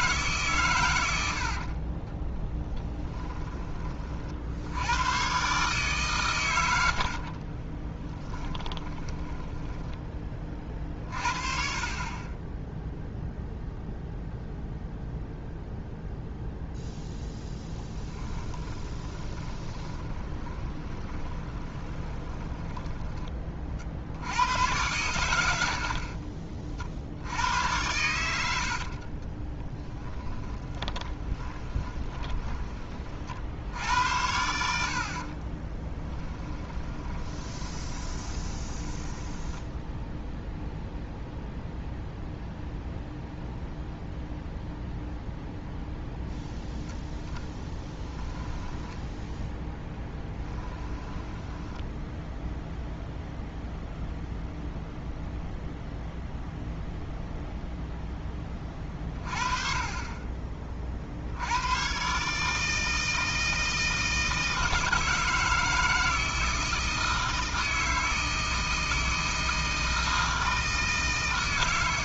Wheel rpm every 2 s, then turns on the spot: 150, 30, 40, 140, 30, 10, 30, 0, 0, 10, 20, 20, 70, 50, 90, 10, 20, 80, 10, 20, 0, 0, 0, 0, 10, 10, 10, 0, 0, 10, 30, 130, 160, 160, 160, 160.
2-4 8-10 18-24 26-28 30-34 36-40